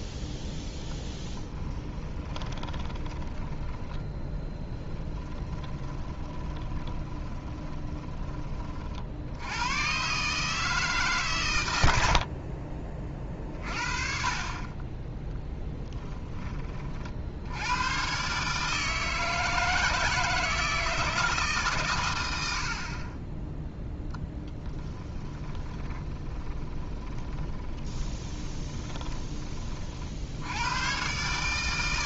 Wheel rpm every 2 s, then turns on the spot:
10, 20, 10, 10, 40, 150, 20, 30, 30, 150, 160, 50, 10, 20, 20, 120.
2-8 12-14 24-30